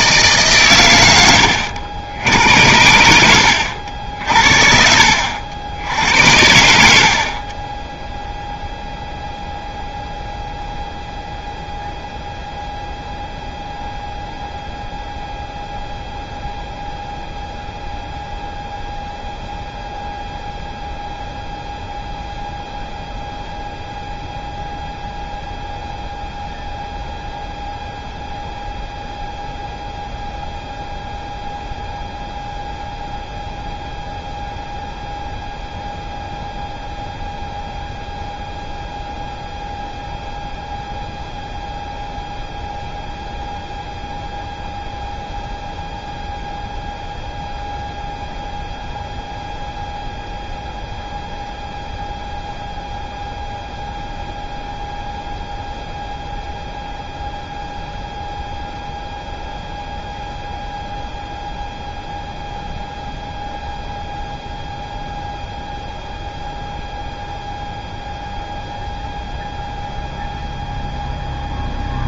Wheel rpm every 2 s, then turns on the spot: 130, 90, 50, 80, 0, 0, 0, 0, 0, 0, 0, 0, 0, 0, 0, 0, 0, 0, 0, 0, 0, 0, 0, 0, 0, 0, 0, 0, 0, 0, 0, 0, 0, 0, 0, 0.
none